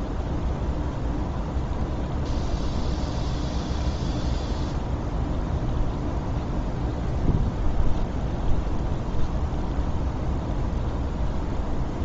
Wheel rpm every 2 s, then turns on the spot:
0, 0, 0, 0, 0, 0.
none